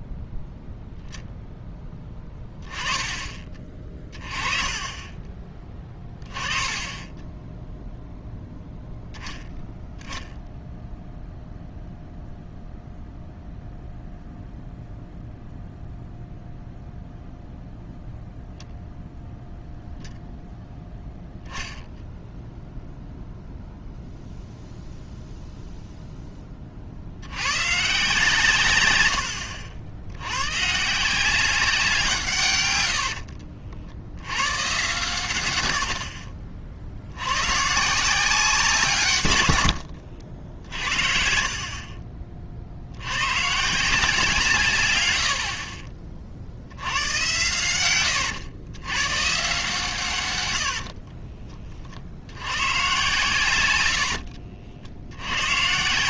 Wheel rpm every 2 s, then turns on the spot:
10, 10, 20, 20, 0, 0, 0, 0, 0, 0, 0, 0, 0, 30, 130, 130, 120, 110, 50, 160, 50, 50, 130, 80, 120, 80, 110, 60.
2-4 6-8 40-42 50-52